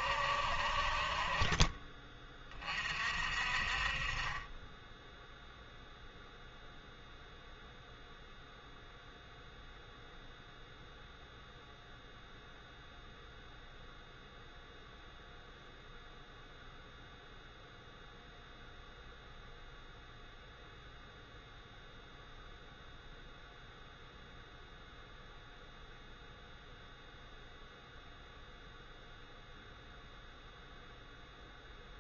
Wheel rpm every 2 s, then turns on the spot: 60, 30, 20, 0, 0, 0, 0, 0, 0, 0, 0, 0, 0, 0, 0, 0.
none